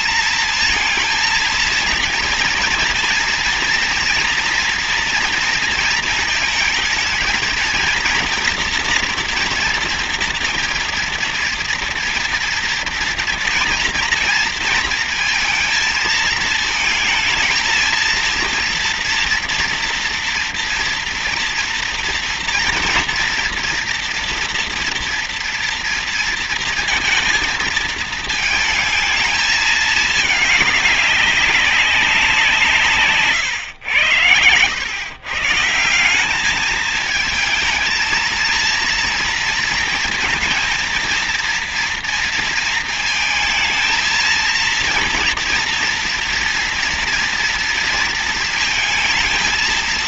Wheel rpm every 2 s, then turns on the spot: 230, 240, 230, 230, 240, 230, 230, 230, 220, 230, 240, 240, 230, 230, 220, 200, 140, 120, 220, 230, 230, 220, 230, 230, 220.
none